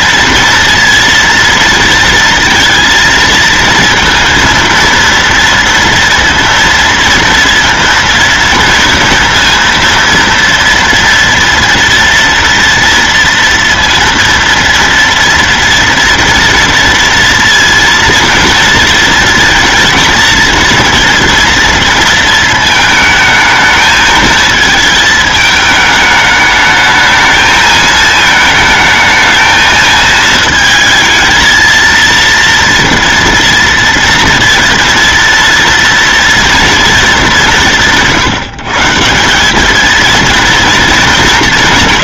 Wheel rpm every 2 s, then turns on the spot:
230, 230, 230, 230, 230, 230, 230, 230, 230, 230, 230, 220, 220, 210, 220, 220, 230, 230, 230, 150, 230.
none